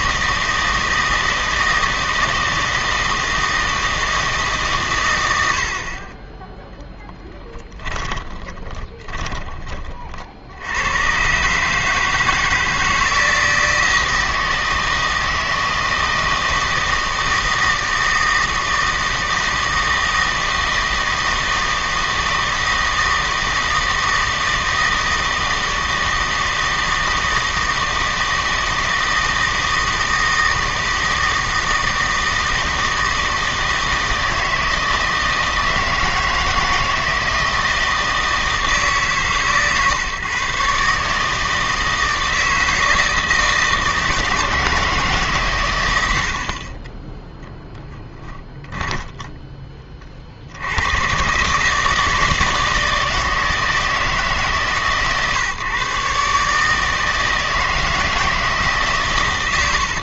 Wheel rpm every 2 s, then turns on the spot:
160, 160, 140, 10, 20, 90, 160, 160, 160, 160, 160, 160, 160, 160, 160, 160, 160, 160, 160, 160, 140, 160, 160, 30, 20, 90, 160, 150, 150, 150.
8-10 48-50